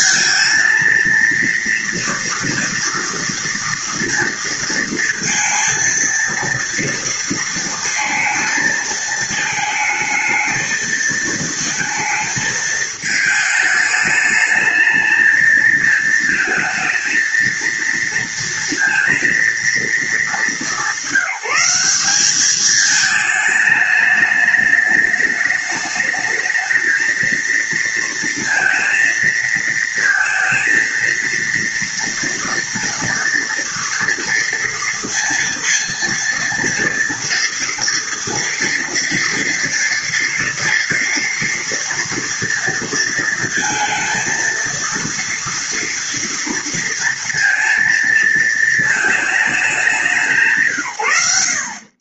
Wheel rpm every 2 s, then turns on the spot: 230, 230, 230, 230, 220, 220, 220, 220, 220, 230, 200, 210, 210, 220, 230, 230, 230, 230, 230, 230, 230, 230, 230, 230, 220, 130.
none